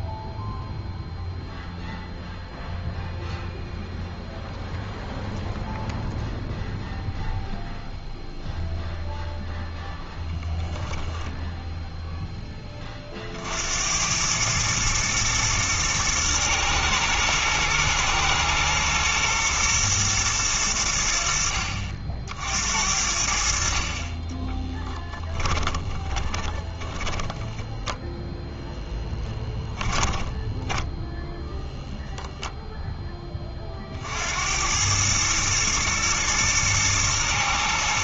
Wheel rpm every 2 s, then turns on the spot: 0, 0, 0, 0, 0, 0, 20, 110, 110, 120, 100, 70, 10, 20, 10, 10, 0, 90, 110.
24-32